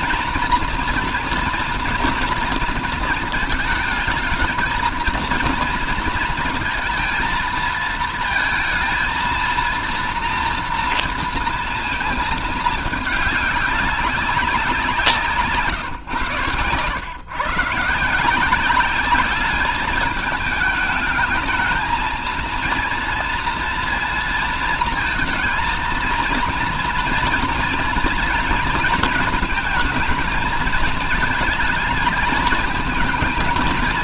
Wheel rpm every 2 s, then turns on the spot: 230, 230, 220, 230, 220, 230, 220, 180, 120, 180, 210, 230, 230, 230, 220, 220, 220.
none